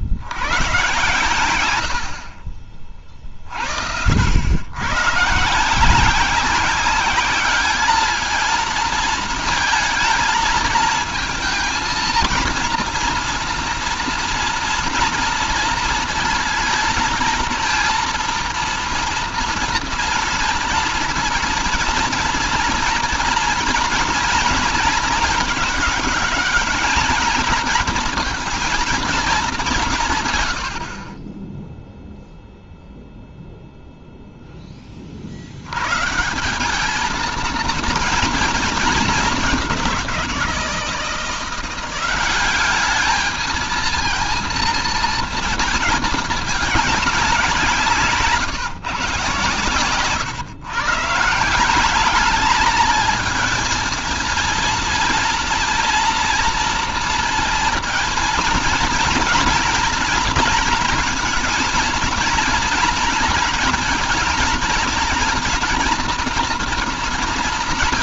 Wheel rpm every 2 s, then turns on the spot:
100, 40, 100, 190, 230, 230, 230, 240, 230, 230, 230, 230, 230, 210, 220, 70, 0, 20, 200, 220, 170, 200, 230, 200, 140, 140, 220, 230, 230, 240, 230, 230, 230, 230.
none